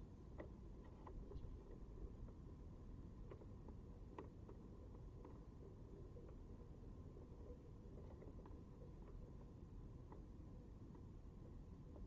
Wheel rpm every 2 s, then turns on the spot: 0, 0, 0, 0, 0, 0.
none